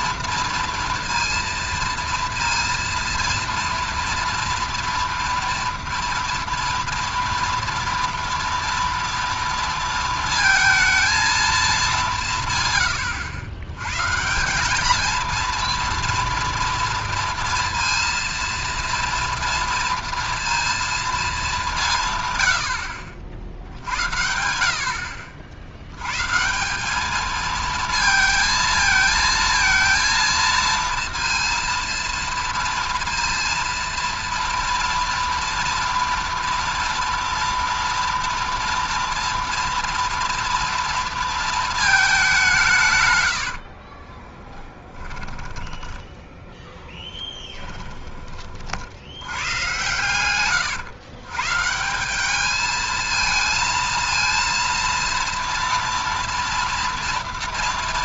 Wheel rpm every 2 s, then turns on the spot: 230, 230, 240, 230, 230, 230, 140, 200, 230, 230, 230, 100, 70, 170, 220, 230, 230, 230, 230, 230, 230, 170, 20, 10, 50, 130, 210, 230, 230.
44-46